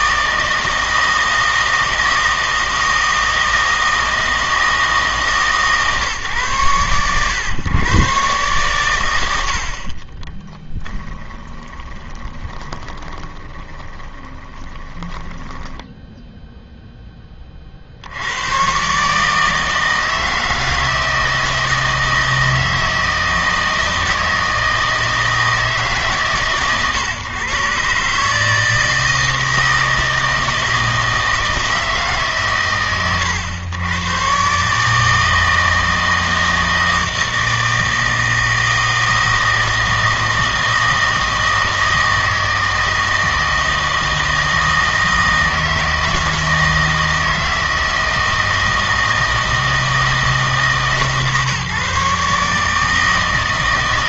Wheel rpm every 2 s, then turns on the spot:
160, 160, 160, 120, 120, 10, 20, 20, 0, 120, 160, 160, 160, 130, 160, 160, 130, 140, 160, 160, 160, 160, 160, 160, 160, 150, 150.
10-16